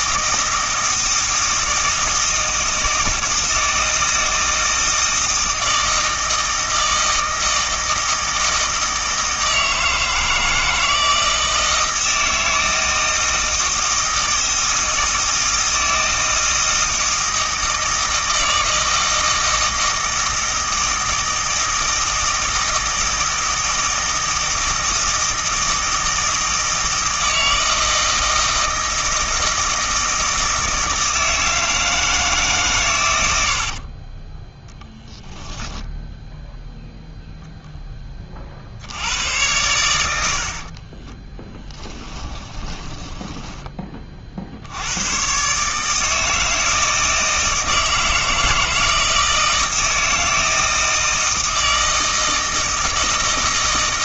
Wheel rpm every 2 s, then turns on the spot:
160, 160, 160, 160, 160, 160, 160, 160, 160, 160, 160, 160, 160, 160, 160, 160, 130, 10, 0, 70, 40, 10, 60, 160, 160, 160, 160.
34-36 40-44